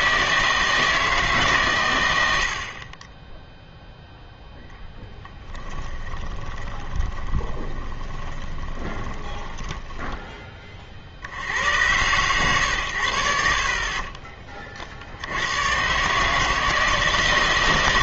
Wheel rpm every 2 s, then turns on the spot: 160, 50, 10, 20, 20, 30, 110, 40, 160.
6-10